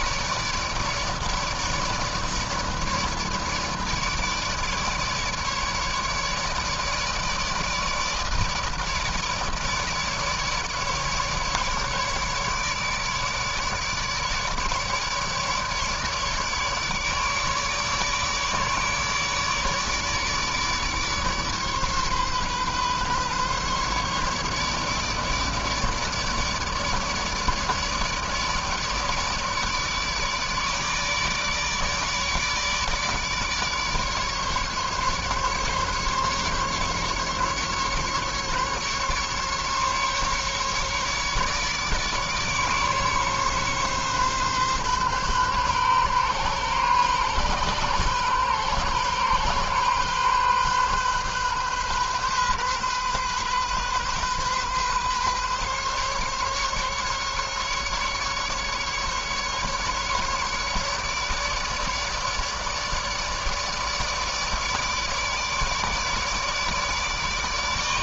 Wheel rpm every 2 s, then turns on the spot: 150, 150, 150, 150, 160, 150, 150, 150, 150, 150, 150, 140, 150, 150, 150, 150, 150, 140, 140, 150, 150, 150, 130, 130, 130, 130, 130, 130, 140, 140, 150, 150, 150, 150.
none